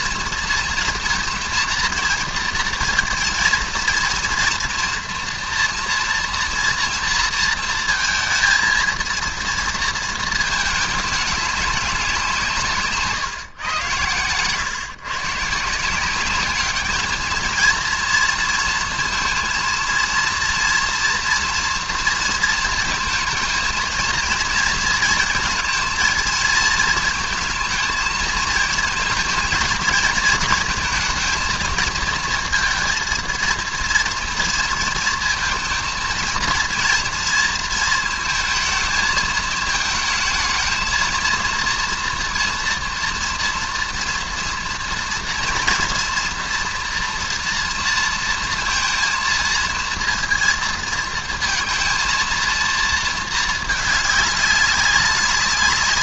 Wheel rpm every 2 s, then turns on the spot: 230, 230, 230, 230, 230, 220, 160, 120, 210, 230, 230, 230, 230, 230, 230, 220, 230, 230, 230, 220, 220, 230, 230, 230, 220, 230, 230, 200.
none